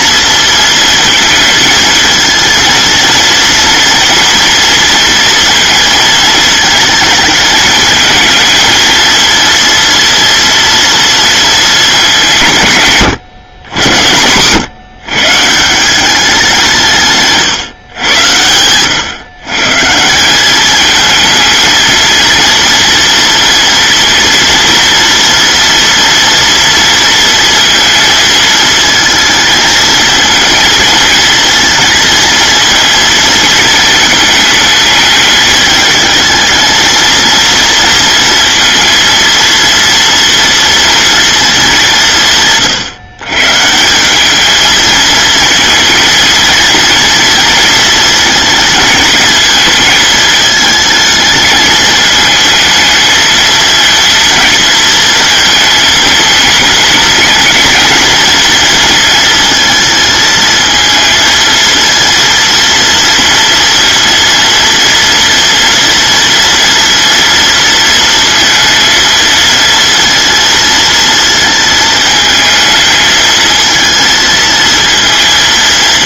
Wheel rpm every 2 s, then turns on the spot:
230, 230, 230, 220, 220, 230, 160, 120, 180, 120, 210, 230, 230, 230, 220, 220, 230, 220, 220, 230, 230, 140, 220, 230, 220, 220, 220, 230, 220, 230, 220, 230, 230, 230, 230, 230, 220, 230.
none